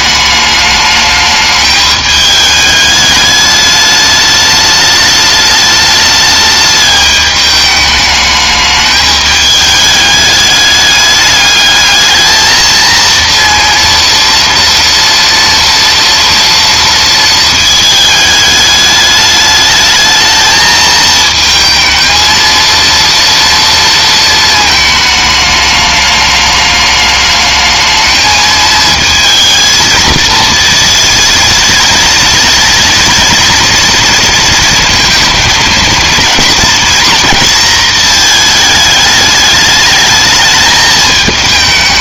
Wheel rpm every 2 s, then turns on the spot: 210, 210, 210, 210, 210, 210, 220, 230, 230, 210, 220, 230, 230, 210, 220, 230, 230, 230, 230, 220, 210.
none